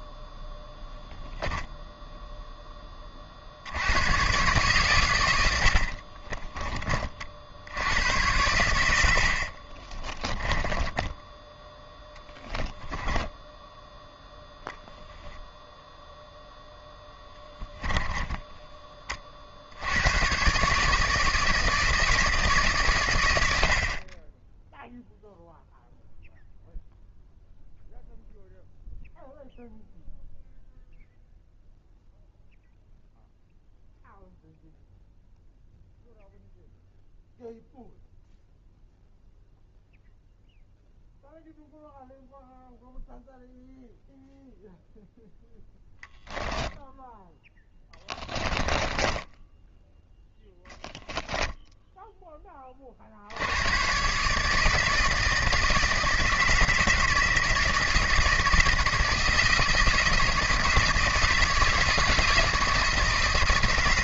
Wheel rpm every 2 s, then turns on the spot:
0, 10, 120, 30, 90, 10, 10, 0, 10, 20, 140, 140, 10, 0, 0, 0, 0, 0, 0, 0, 0, 0, 0, 0, 10, 0, 30, 160, 160, 160, 160, 160.
10-14 48-50